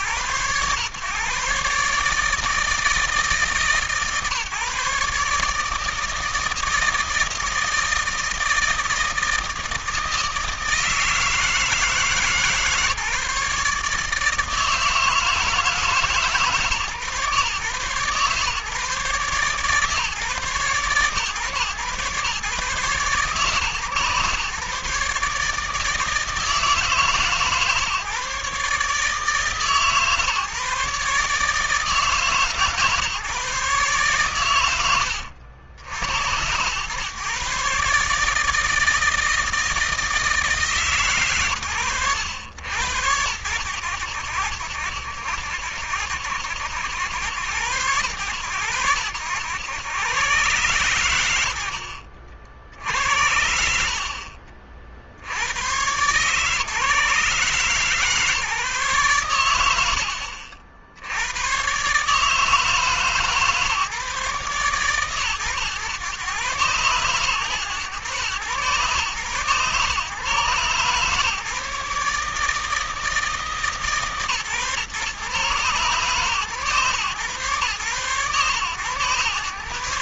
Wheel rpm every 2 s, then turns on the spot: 120, 160, 150, 160, 160, 160, 150, 160, 140, 140, 130, 130, 140, 150, 150, 150, 150, 110, 110, 160, 140, 90, 80, 90, 90, 110, 80, 70, 150, 140, 80, 160, 130, 120, 130, 140, 160, 130, 130, 130.
52-54